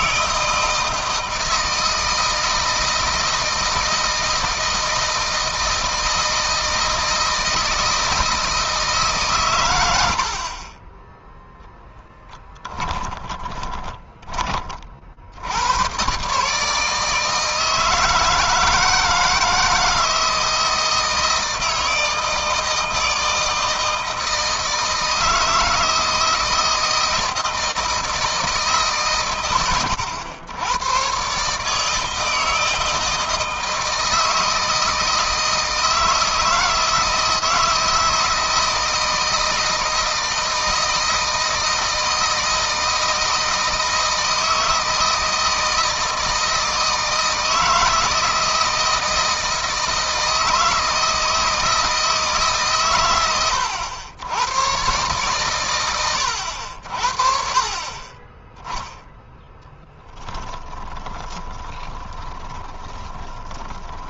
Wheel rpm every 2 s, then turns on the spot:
160, 160, 160, 160, 150, 20, 10, 40, 160, 160, 160, 160, 160, 160, 140, 120, 160, 160, 160, 160, 160, 160, 160, 160, 160, 160, 130, 120, 60, 0, 20, 20.
12-14 60-64